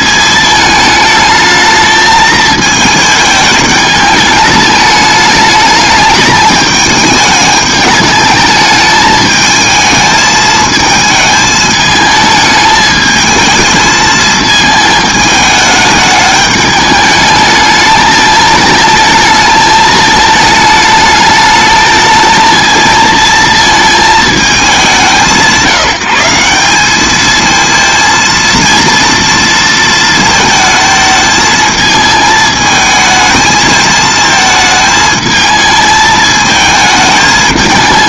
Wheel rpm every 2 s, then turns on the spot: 220, 220, 210, 210, 210, 220, 220, 220, 210, 220, 210, 220, 200, 190, 230, 220, 220, 220, 220.
none